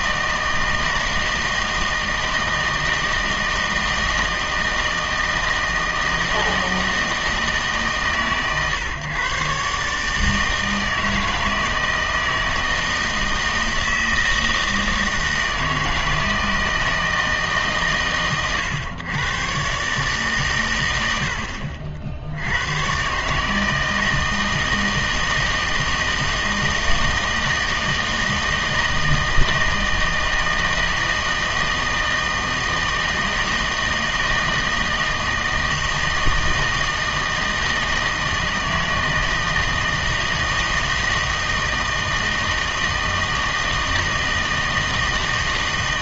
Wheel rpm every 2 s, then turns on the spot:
160, 160, 160, 160, 130, 160, 160, 160, 160, 120, 120, 90, 160, 160, 160, 160, 160, 160, 160, 160, 160, 160, 160.
none